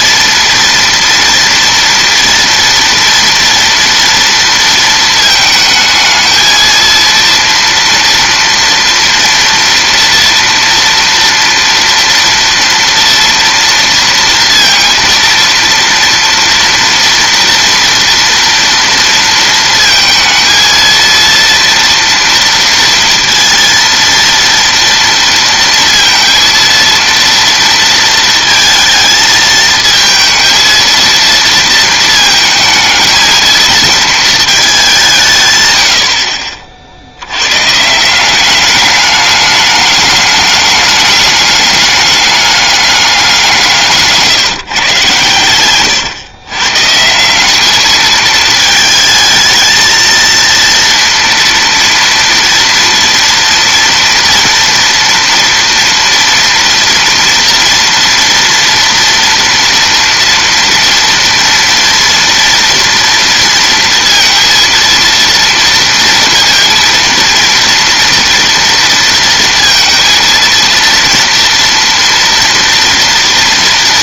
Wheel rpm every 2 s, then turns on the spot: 230, 230, 230, 230, 230, 230, 230, 230, 230, 230, 220, 230, 230, 230, 220, 230, 220, 210, 50, 200, 210, 210, 160, 120, 220, 230, 240, 230, 230, 230, 230, 230, 230, 230, 230, 230, 230.
none